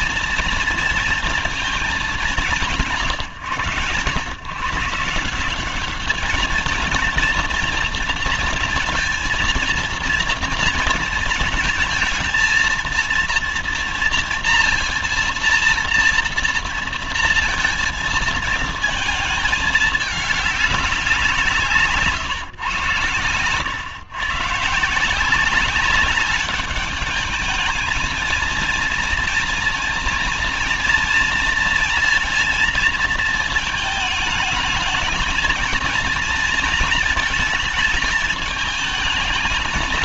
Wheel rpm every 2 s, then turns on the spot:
230, 190, 140, 220, 230, 230, 230, 240, 230, 230, 210, 130, 150, 200, 220, 230, 220, 220, 230, 210.
none